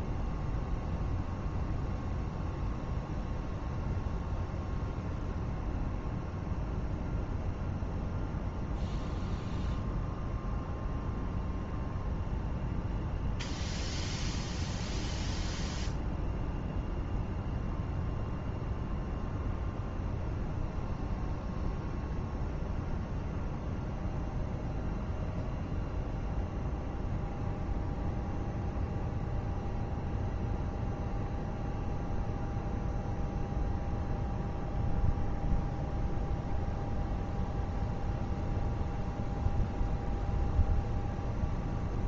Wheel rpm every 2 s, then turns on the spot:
0, 0, 0, 0, 0, 0, 0, 0, 0, 0, 0, 0, 0, 0, 0, 0, 0, 0, 0, 0, 0.
none